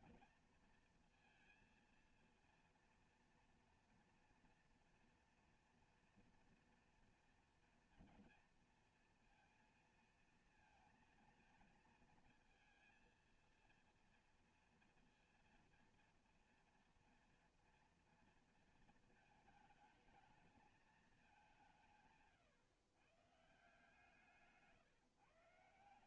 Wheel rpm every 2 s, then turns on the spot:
230, 230, 230, 230, 230, 230, 220, 230, 230, 220, 220, 140, 150.
none